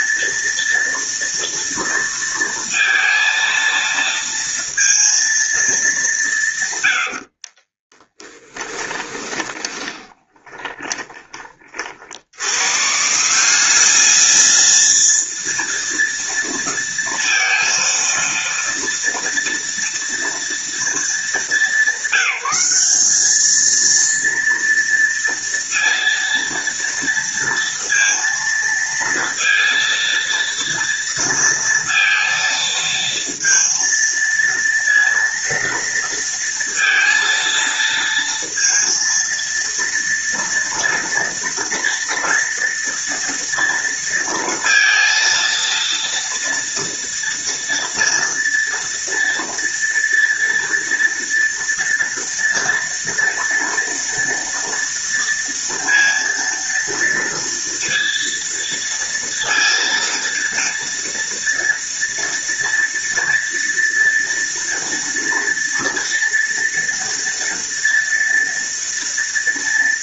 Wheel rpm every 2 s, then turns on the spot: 230, 230, 230, 100, 20, 20, 130, 230, 230, 230, 230, 200, 230, 230, 230, 230, 230, 230, 230, 230, 230, 230, 230, 230, 230, 230, 230, 230, 230, 230, 230, 230, 230, 230, 230.
6-12